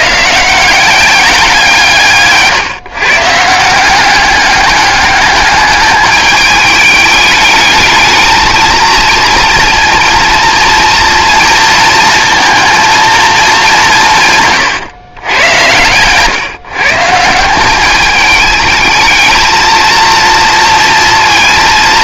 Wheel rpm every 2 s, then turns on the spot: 170, 140, 200, 210, 230, 230, 230, 130, 150, 210, 230.
none